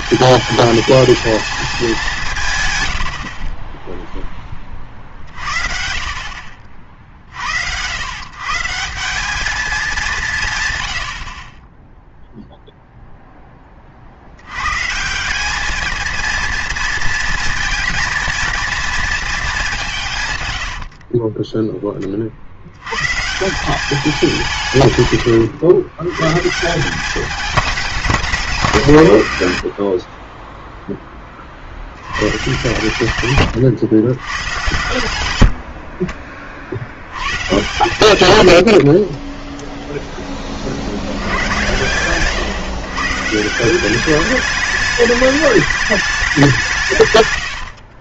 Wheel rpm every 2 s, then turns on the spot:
220, 140, 30, 50, 160, 140, 0, 110, 230, 230, 90, 80, 150, 160, 160, 10, 120, 100, 50, 90, 40, 130, 200, 150.
20-22